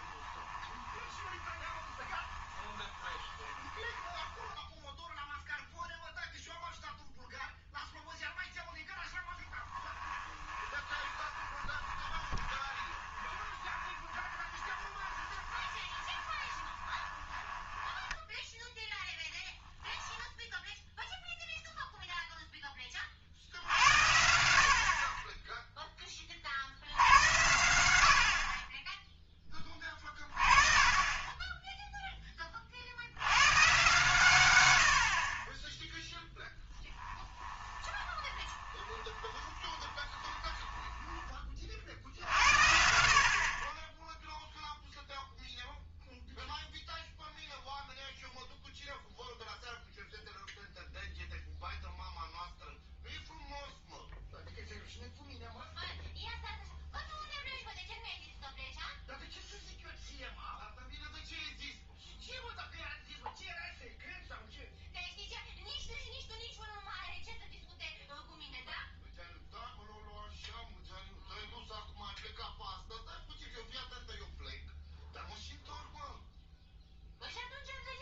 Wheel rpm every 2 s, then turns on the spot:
20, 20, 10, 0, 0, 20, 20, 20, 20, 10, 0, 10, 60, 70, 30, 30, 40, 100, 20, 20, 10, 60, 0, 0, 0, 0, 0, 0, 0, 0, 0, 0, 0, 0, 0, 0, 0, 0, 0.
0-6 10-18 36-42